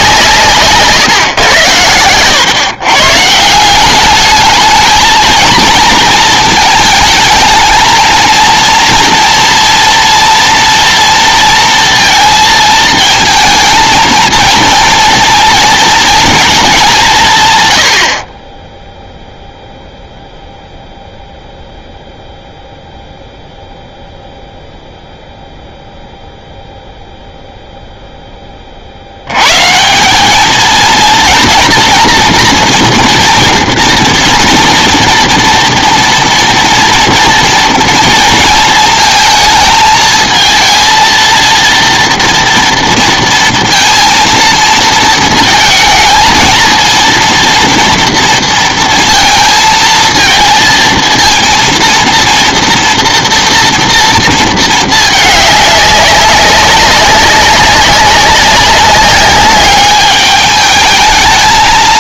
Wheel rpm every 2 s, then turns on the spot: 140, 130, 210, 220, 230, 230, 230, 230, 230, 20, 0, 0, 0, 0, 30, 220, 230, 230, 240, 230, 220, 230, 230, 230, 230, 230, 230, 230, 190, 200, 210.
none